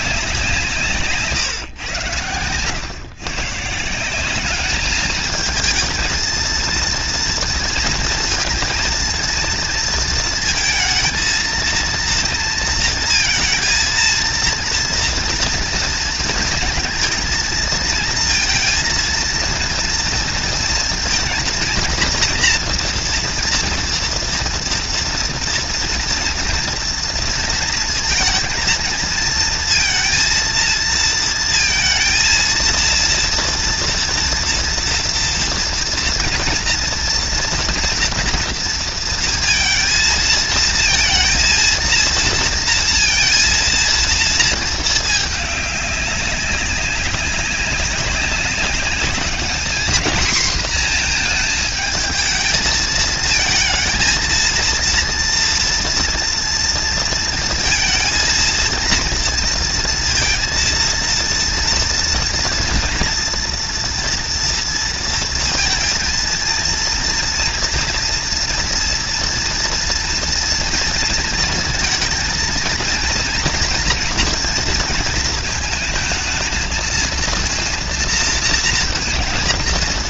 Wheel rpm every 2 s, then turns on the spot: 150, 140, 210, 230, 230, 220, 230, 230, 230, 230, 230, 230, 230, 230, 230, 230, 230, 230, 230, 230, 230, 230, 210, 200, 200, 230, 220, 230, 230, 230, 230, 230, 230, 230, 230, 230, 230, 220, 230, 230.
0-2